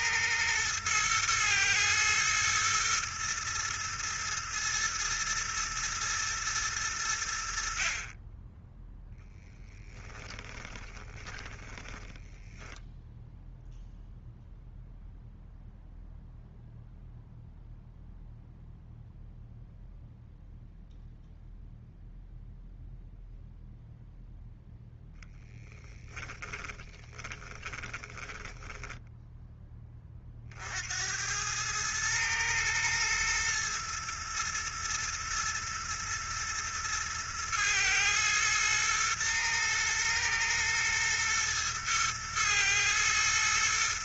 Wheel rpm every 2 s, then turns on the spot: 110, 110, 110, 110, 10, 20, 0, 0, 0, 0, 0, 0, 0, 20, 10, 80, 110, 110, 110, 110, 110, 110.
10-12 26-30